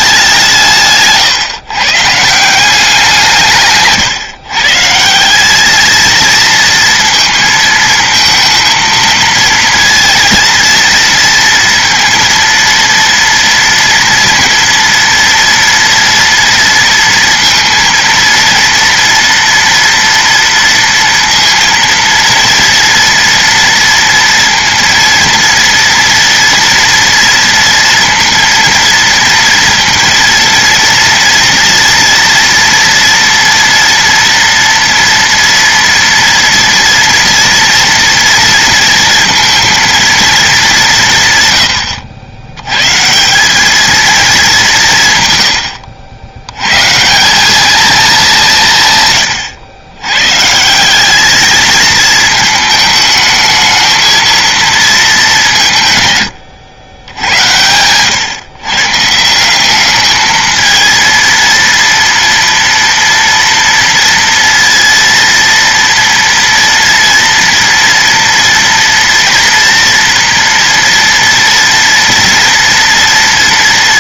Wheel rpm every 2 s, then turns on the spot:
170, 180, 140, 230, 220, 230, 230, 230, 230, 230, 230, 230, 230, 230, 230, 230, 240, 230, 230, 230, 200, 110, 180, 130, 160, 170, 220, 230, 100, 130, 220, 230, 230, 230, 230, 230, 230.
none